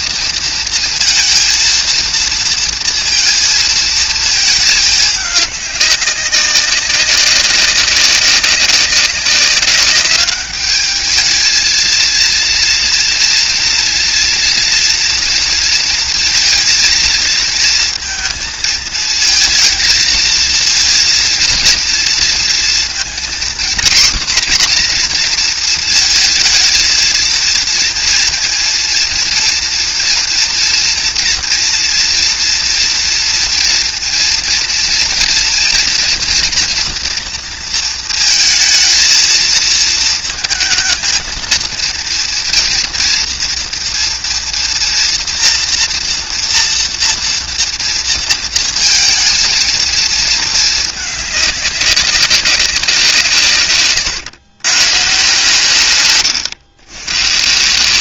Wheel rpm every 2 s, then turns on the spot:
230, 230, 210, 190, 200, 210, 230, 230, 220, 220, 230, 230, 240, 220, 230, 230, 230, 230, 240, 230, 220, 230, 230, 230, 220, 220, 190, 130, 120.
none